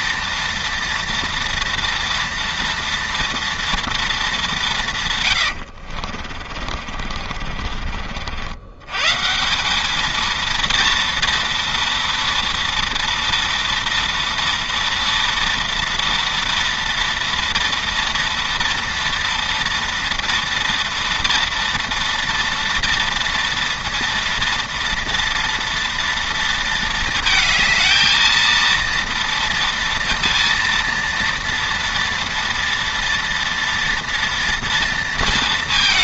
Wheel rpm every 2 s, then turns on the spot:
230, 230, 120, 50, 150, 230, 230, 230, 230, 230, 230, 230, 230, 220, 230, 230, 230, 220.
4-8